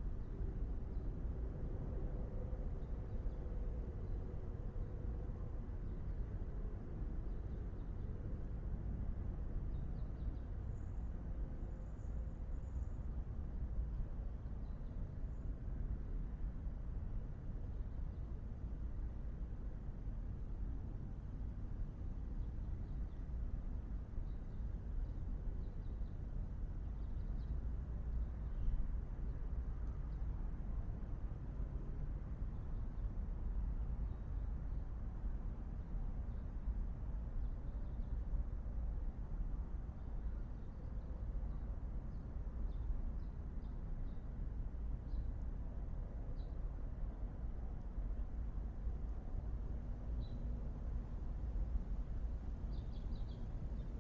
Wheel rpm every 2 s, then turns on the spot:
0, 0, 0, 0, 0, 0, 0, 0, 0, 0, 0, 0, 0, 0, 0, 0, 0, 0, 0, 0, 0, 0, 0, 0, 0, 0, 0.
none